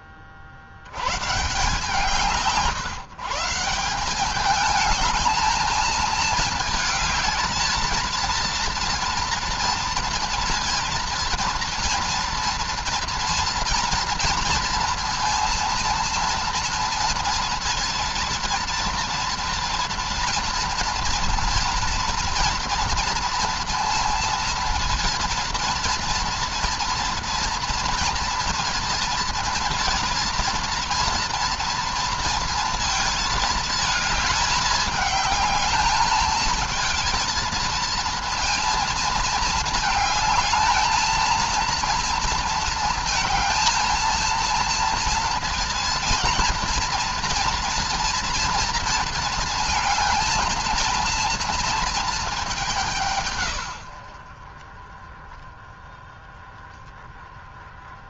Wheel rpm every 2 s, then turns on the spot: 70, 150, 210, 220, 230, 230, 230, 230, 230, 230, 230, 230, 230, 230, 230, 230, 230, 210, 220, 230, 220, 230, 230, 230, 230, 230, 200, 40, 20.
none